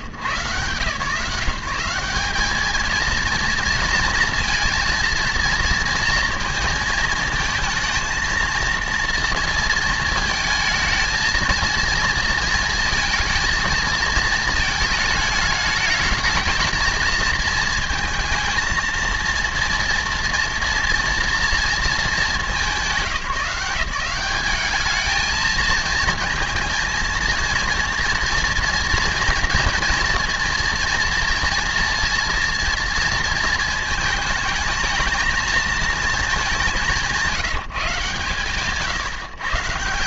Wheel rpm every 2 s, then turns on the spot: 130, 200, 230, 230, 230, 220, 230, 220, 210, 220, 230, 220, 190, 230, 230, 230, 230, 220, 210, 140.
none